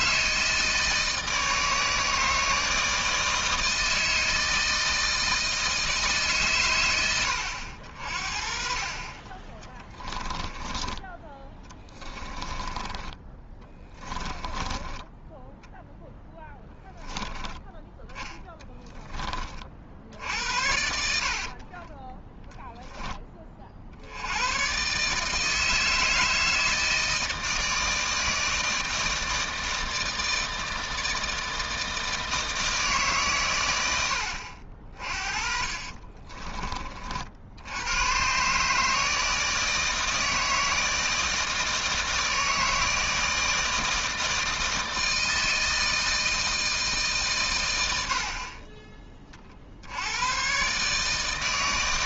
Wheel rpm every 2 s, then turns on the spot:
160, 160, 160, 110, 40, 10, 20, 20, 10, 10, 70, 10, 130, 160, 160, 160, 150, 40, 40, 150, 160, 160, 160, 150, 30, 140.
10-16 20-22